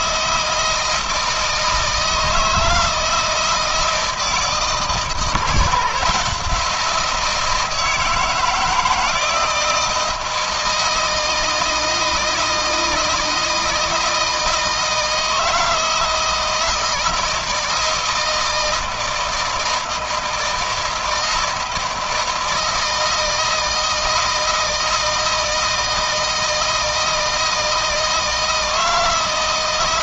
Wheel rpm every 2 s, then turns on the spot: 160, 160, 160, 170, 160, 160, 160, 160, 160, 160, 160, 160, 160, 160, 160.
none